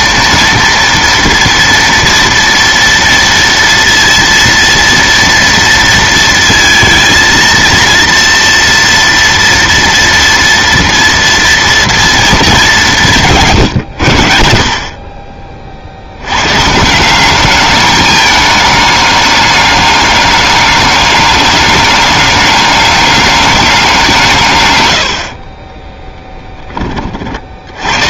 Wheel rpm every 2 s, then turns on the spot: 230, 230, 230, 230, 230, 230, 180, 40, 180, 210, 200, 200, 90, 20.
24-28